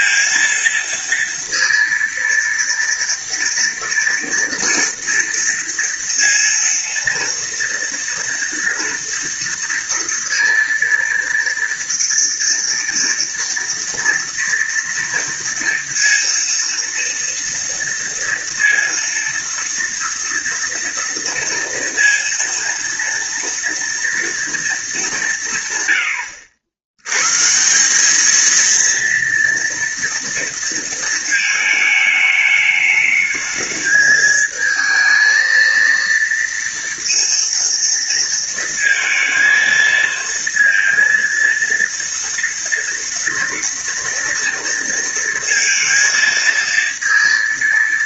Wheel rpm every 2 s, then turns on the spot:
230, 230, 230, 230, 230, 230, 230, 230, 230, 230, 230, 230, 230, 80, 230, 230, 210, 220, 230, 230, 230, 230, 230, 230.
none